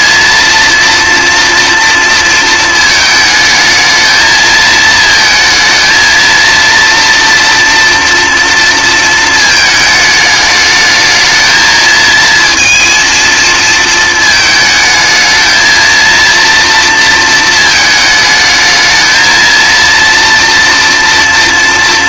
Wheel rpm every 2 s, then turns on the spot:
230, 220, 220, 230, 230, 210, 230, 220, 230, 220, 230.
none